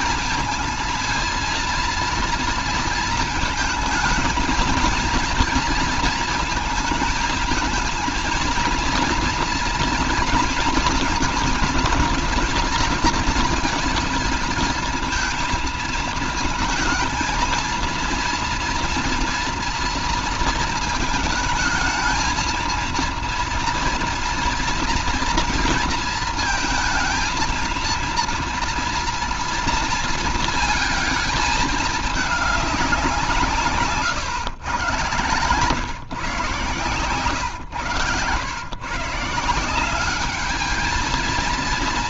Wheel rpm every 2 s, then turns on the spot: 220, 230, 230, 230, 230, 230, 230, 230, 220, 230, 230, 230, 230, 230, 230, 230, 210, 130, 130, 110, 210.
none